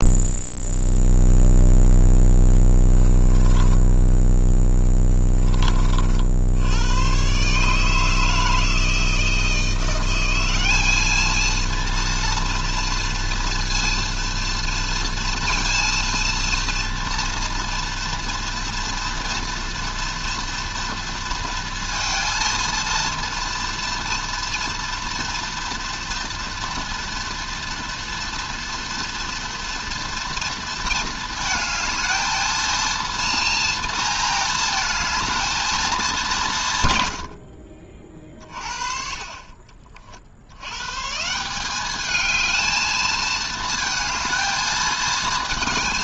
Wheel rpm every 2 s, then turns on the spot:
0, 10, 20, 120, 160, 210, 230, 230, 230, 230, 230, 230, 230, 230, 230, 220, 230, 230, 110, 40, 150, 220, 220.
2-4